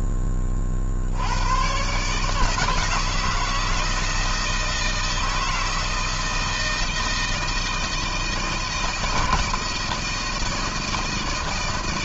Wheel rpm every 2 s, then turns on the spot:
70, 160, 160, 160, 160, 160.
none